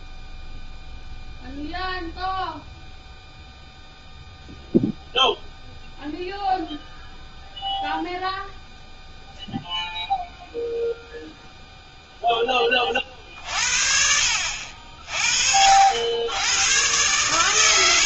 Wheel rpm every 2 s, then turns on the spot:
0, 0, 0, 0, 0, 0, 10, 60, 110.
none